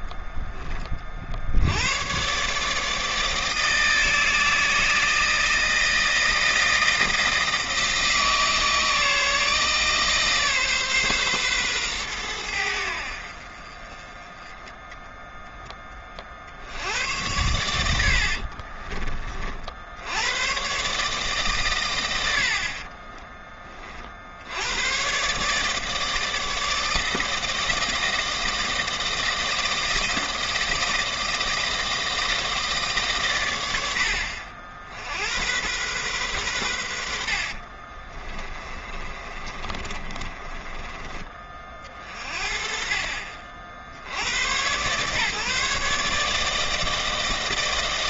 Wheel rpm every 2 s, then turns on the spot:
20, 150, 160, 170, 160, 140, 80, 10, 70, 40, 130, 50, 90, 160, 160, 160, 160, 70, 90, 20, 20, 40, 120, 160.
18-20 38-42